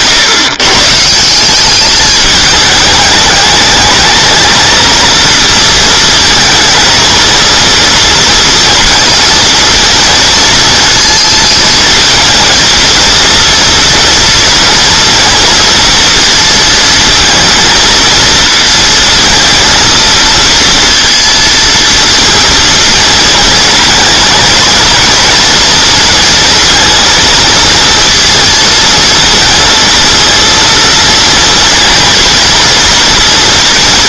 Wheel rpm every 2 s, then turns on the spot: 130, 220, 220, 230, 230, 230, 230, 230, 230, 230, 230, 220, 220, 230, 230, 230, 230.
none